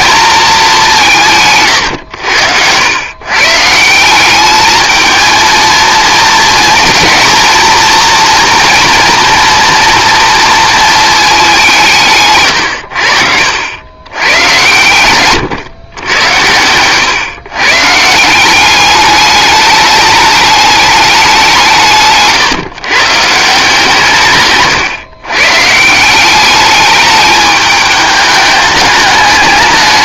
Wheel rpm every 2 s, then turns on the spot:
200, 90, 210, 220, 240, 220, 110, 120, 110, 200, 210, 140, 140, 210, 210.
none